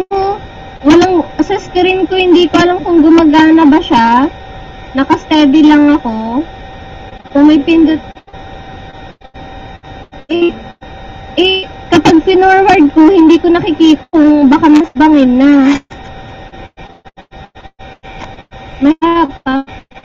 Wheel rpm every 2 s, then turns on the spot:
0, 0, 0, 0, 0, 0, 0, 0, 0, 0.
none